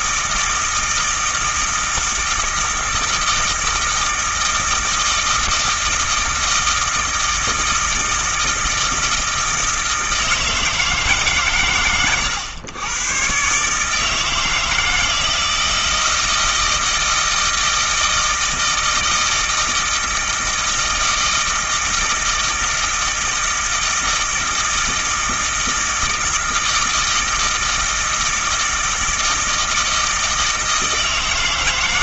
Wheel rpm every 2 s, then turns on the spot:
160, 160, 160, 160, 160, 160, 110, 160, 160, 160, 160, 160, 160, 160, 160, 160.
none